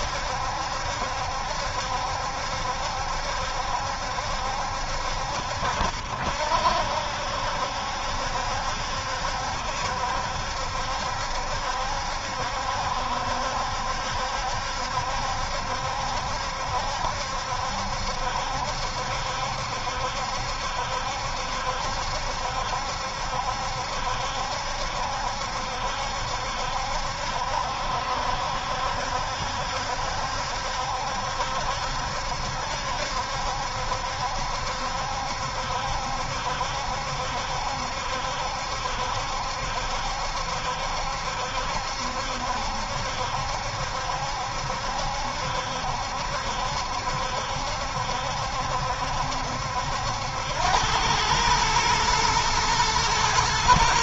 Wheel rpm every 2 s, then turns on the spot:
70, 70, 70, 70, 70, 70, 70, 70, 70, 70, 70, 70, 70, 70, 70, 70, 70, 70, 70, 70, 70, 70, 70, 70, 70, 100, 110.
none